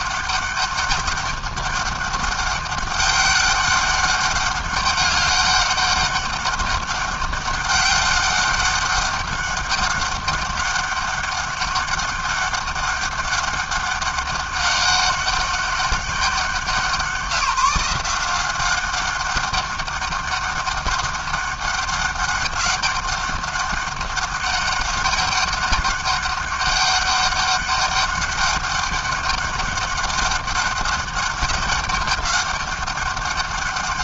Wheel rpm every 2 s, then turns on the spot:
200, 200, 200, 200, 200, 200, 200, 200, 180, 200, 200, 200, 200, 200, 200, 200, 200.
none